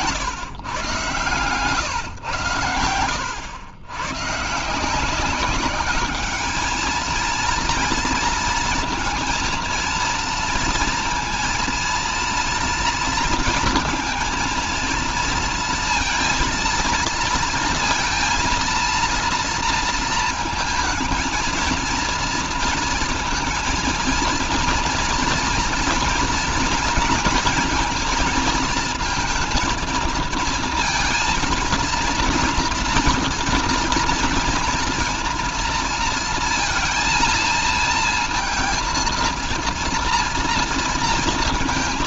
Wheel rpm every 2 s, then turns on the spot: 120, 100, 170, 220, 230, 230, 230, 230, 230, 230, 230, 230, 230, 230, 230, 230, 230, 230, 230, 230, 230.
none